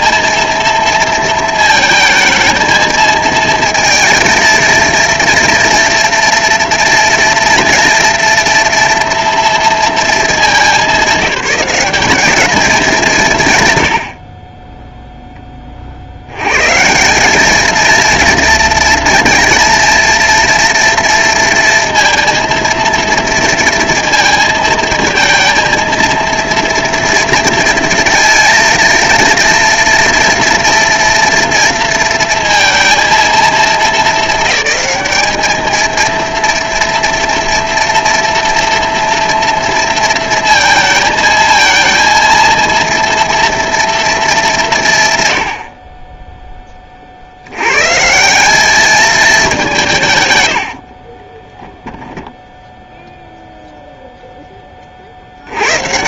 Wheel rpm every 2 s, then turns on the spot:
230, 220, 230, 230, 230, 200, 210, 10, 140, 230, 230, 230, 220, 230, 230, 230, 230, 220, 240, 230, 230, 230, 150, 20, 200, 80, 0, 20.
50-52